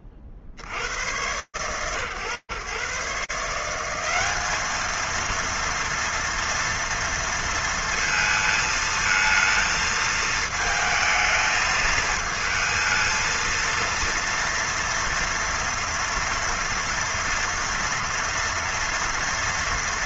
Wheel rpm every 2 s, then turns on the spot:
20, 120, 180, 230, 230, 220, 220, 230, 230, 230.
none